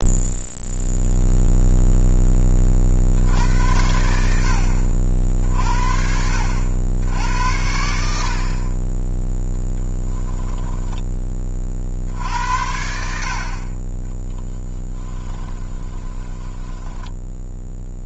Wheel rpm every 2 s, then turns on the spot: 0, 40, 60, 70, 20, 10, 70, 30, 10.
14-18